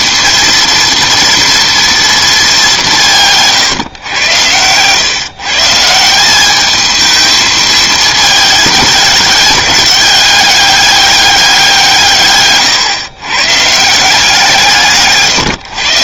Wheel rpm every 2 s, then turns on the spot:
230, 200, 110, 210, 210, 200, 130, 160.
4-6 12-14